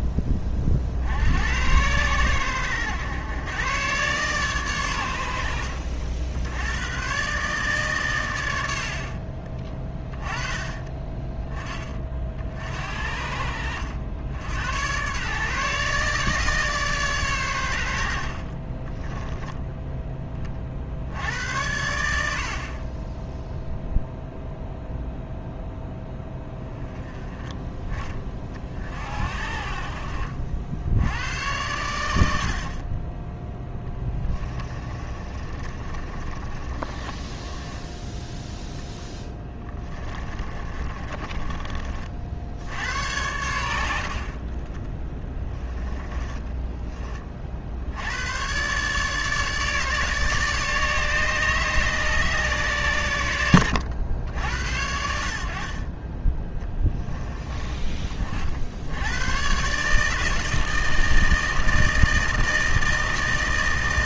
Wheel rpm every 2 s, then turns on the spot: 50, 100, 110, 110, 70, 20, 70, 110, 140, 30, 60, 30, 0, 10, 40, 80, 40, 30, 30, 0, 30, 80, 10, 20, 140, 150, 120, 70, 10, 80, 160, 160.
18-20 34-38 40-42